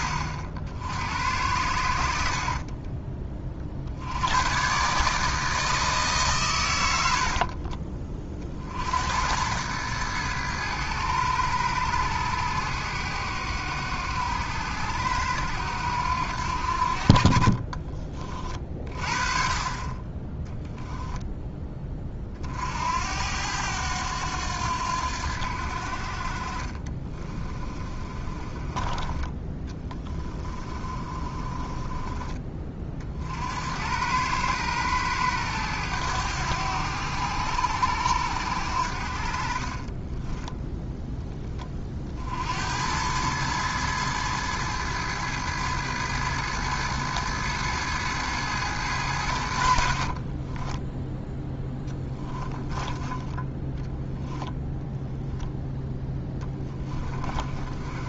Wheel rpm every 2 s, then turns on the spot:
70, 30, 130, 100, 60, 110, 100, 90, 60, 40, 10, 60, 90, 40, 20, 30, 30, 110, 90, 70, 0, 80, 110, 110, 100, 10, 10, 0, 20.
26-32 50-54 56-58